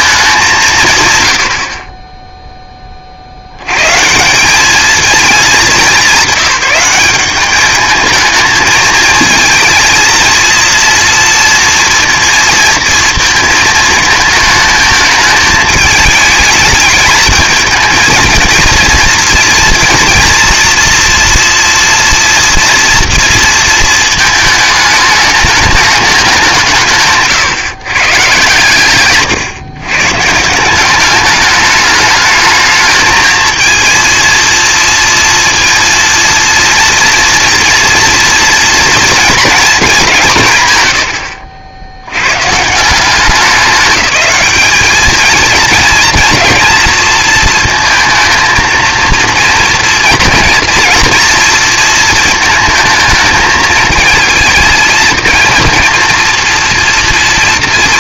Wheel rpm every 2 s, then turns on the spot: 160, 20, 210, 190, 220, 230, 230, 220, 210, 230, 240, 230, 210, 170, 140, 180, 220, 230, 230, 230, 120, 160, 200, 230, 230, 230, 230, 230, 230.
none